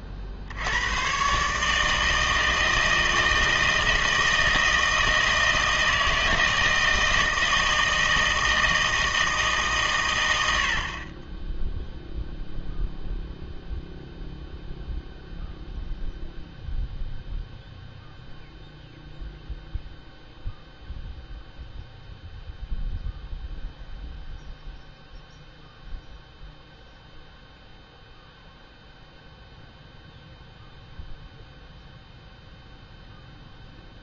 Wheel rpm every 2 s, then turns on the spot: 70, 160, 160, 160, 160, 80, 0, 0, 0, 0, 0, 0, 0, 0, 0, 0, 0.
none